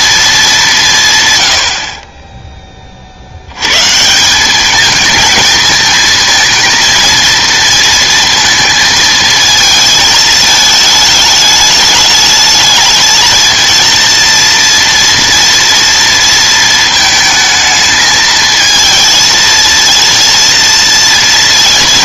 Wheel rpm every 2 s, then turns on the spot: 210, 20, 200, 230, 230, 220, 220, 230, 230, 220, 230.
none